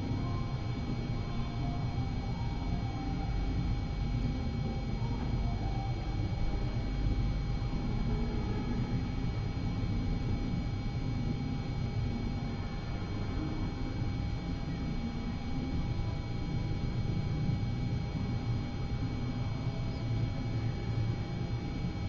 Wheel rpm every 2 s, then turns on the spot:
0, 0, 0, 0, 0, 0, 0, 0, 0, 0, 0.
none